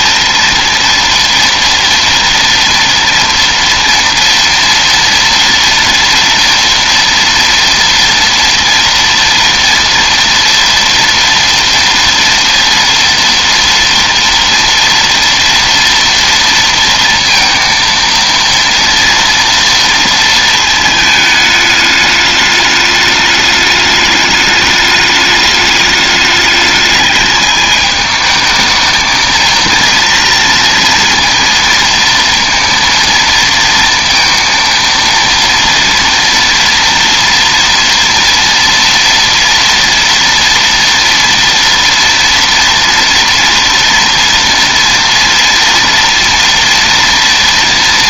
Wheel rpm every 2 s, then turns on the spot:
230, 230, 230, 240, 230, 230, 230, 230, 230, 230, 220, 210, 210, 210, 220, 230, 230, 230, 240, 230, 240, 240, 230, 230.
none